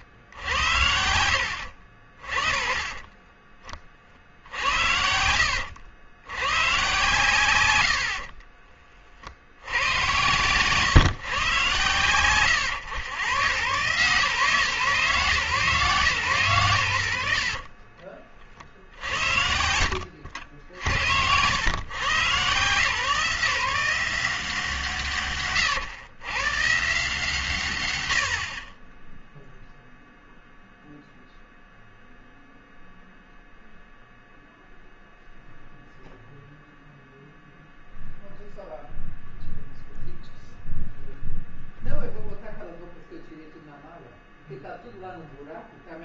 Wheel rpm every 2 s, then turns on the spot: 90, 30, 80, 130, 40, 120, 120, 140, 90, 60, 70, 140, 160, 140, 30, 0, 0, 0, 0, 0, 0, 0, 0.
none